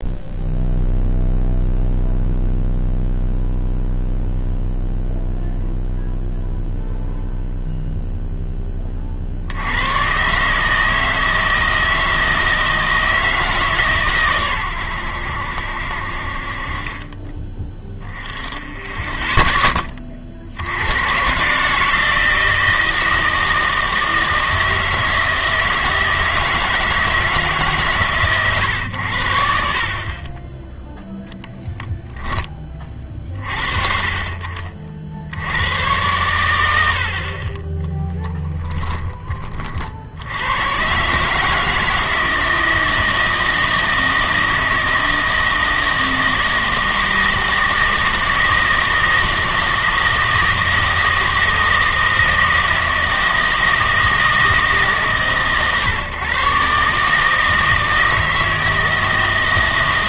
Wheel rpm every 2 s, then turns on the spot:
0, 0, 0, 0, 20, 150, 160, 100, 30, 10, 80, 160, 160, 160, 120, 10, 30, 50, 80, 10, 120, 160, 160, 160, 160, 160, 160, 150, 140, 160.
38-40